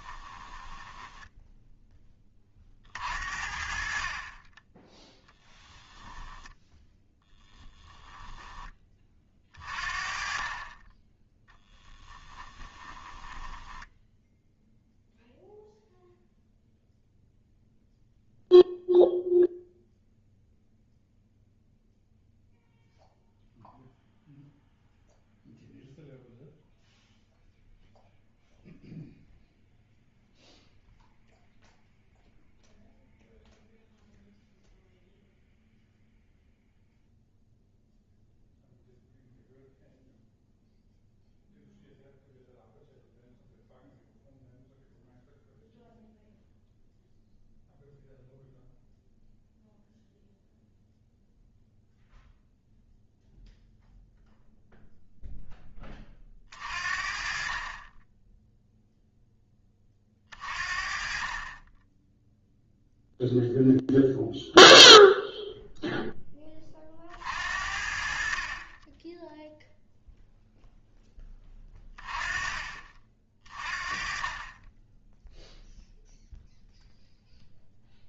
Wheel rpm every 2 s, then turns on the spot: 10, 40, 20, 10, 20, 20, 20, 0, 0, 0, 0, 0, 0, 0, 0, 0, 0, 0, 0, 0, 0, 0, 0, 0, 0, 0, 0, 0, 40, 0, 40, 0, 0, 30, 20, 0, 40, 10, 0.
0-2 6-8 12-14